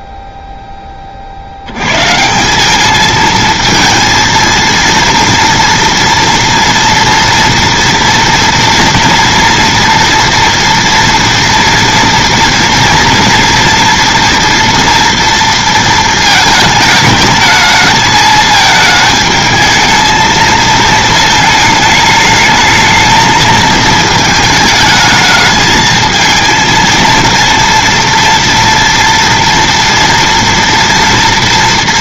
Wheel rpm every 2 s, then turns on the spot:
10, 190, 230, 230, 230, 230, 230, 230, 220, 220, 220, 210, 220, 230, 230, 230.
none